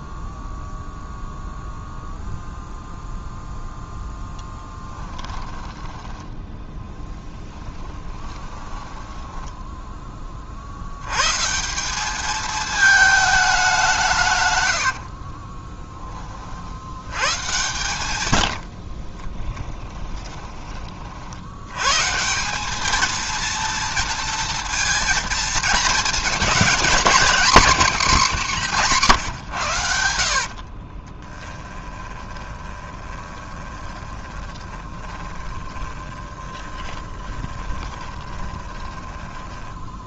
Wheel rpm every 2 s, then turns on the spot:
0, 0, 20, 0, 10, 80, 220, 90, 90, 50, 40, 210, 230, 230, 180, 40, 20, 20, 20, 20.
4-6 8-10 14-16 18-20 30-40